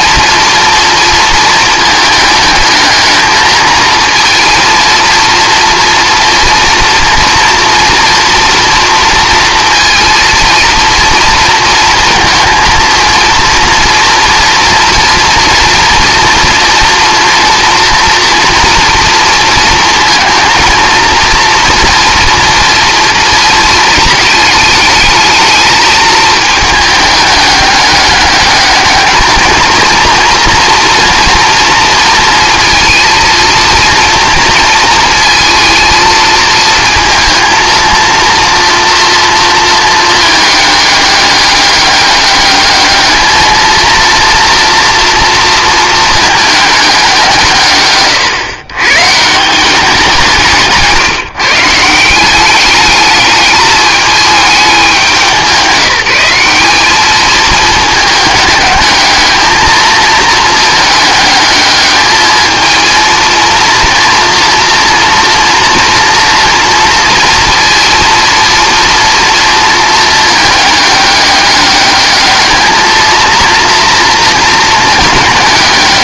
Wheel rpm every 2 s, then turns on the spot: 230, 220, 230, 230, 230, 230, 230, 230, 230, 230, 230, 230, 220, 210, 220, 230, 230, 220, 230, 230, 210, 210, 240, 200, 140, 150, 210, 200, 210, 220, 210, 230, 230, 230, 230, 210, 220, 220.
none